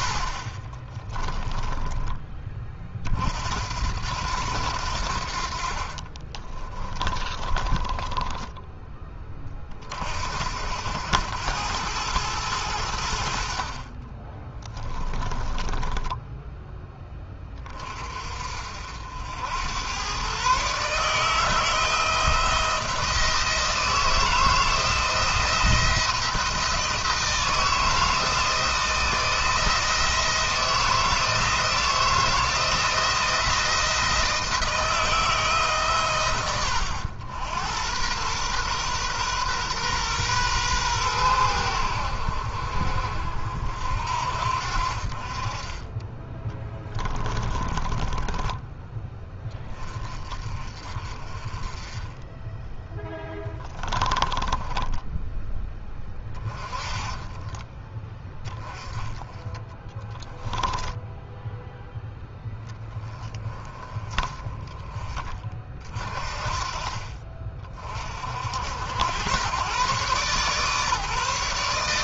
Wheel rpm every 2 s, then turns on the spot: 50, 20, 80, 30, 10, 60, 110, 20, 10, 50, 120, 160, 170, 170, 160, 160, 160, 160, 110, 110, 120, 70, 60, 20, 20, 30, 10, 20, 20, 10, 10, 10, 20, 40, 70, 140.
6-10 14-16 46-50 54-56 60-62